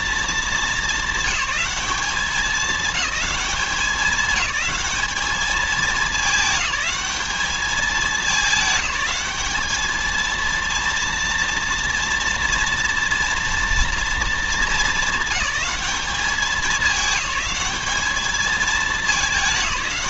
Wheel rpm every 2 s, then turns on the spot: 220, 200, 210, 210, 190, 230, 230, 210, 210, 210.
none